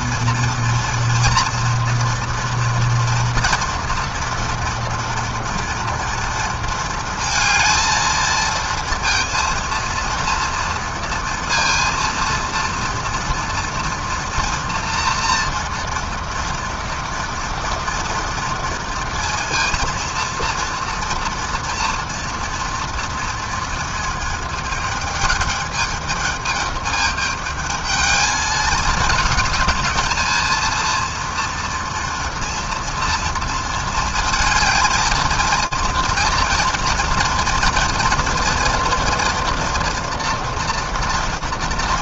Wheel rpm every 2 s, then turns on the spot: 230, 230, 230, 230, 230, 230, 230, 230, 230, 230, 230, 230, 220, 210, 220, 220, 230, 220, 230, 230, 230.
none